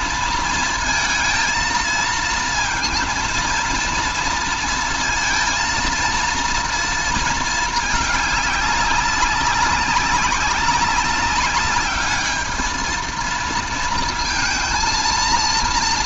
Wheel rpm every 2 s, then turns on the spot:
230, 230, 230, 230, 200, 200, 220, 230.
none